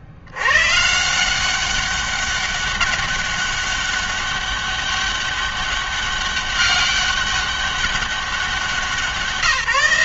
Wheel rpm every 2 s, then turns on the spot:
130, 200, 200, 200, 190.
none